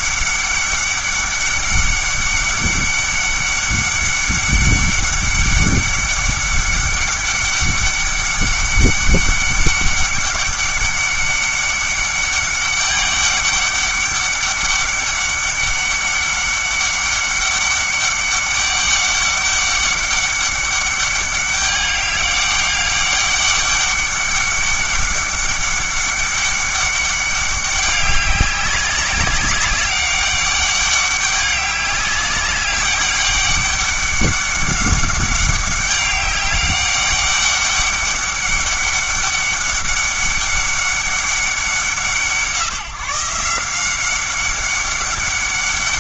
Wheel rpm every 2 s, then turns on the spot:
200, 200, 200, 200, 200, 200, 200, 200, 200, 200, 200, 200, 200, 200, 190, 200, 200, 200, 200, 200, 200, 160, 200.
none